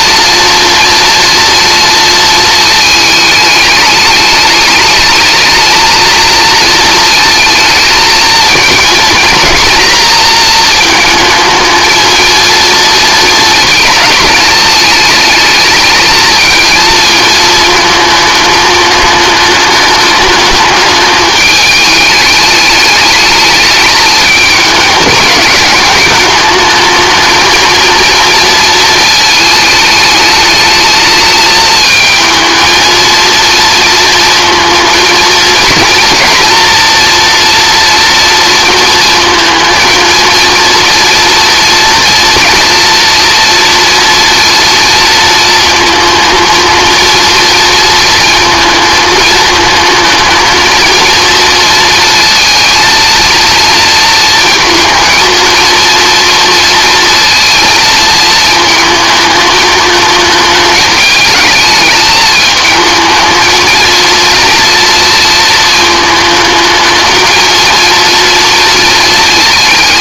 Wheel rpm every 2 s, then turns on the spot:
230, 220, 210, 220, 220, 230, 230, 210, 220, 220, 210, 210, 220, 220, 230, 210, 230, 230, 230, 230, 230, 230, 230, 220, 230, 220, 230, 220, 230, 220, 210, 220, 230, 220, 230.
none